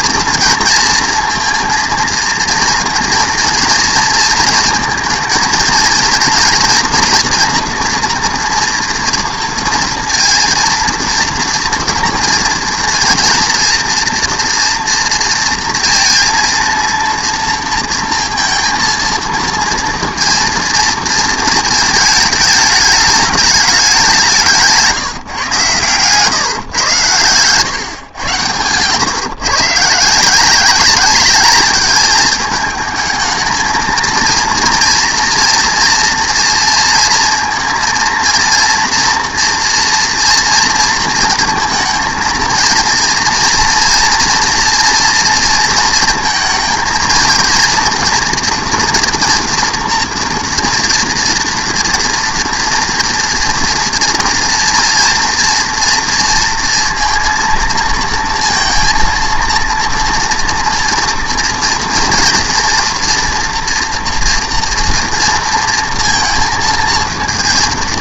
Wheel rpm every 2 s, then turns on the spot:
230, 230, 230, 240, 230, 230, 230, 230, 230, 230, 230, 210, 170, 140, 120, 190, 220, 230, 230, 230, 230, 230, 230, 230, 230, 230, 230, 230, 230, 230, 230, 240, 230, 230.
28-30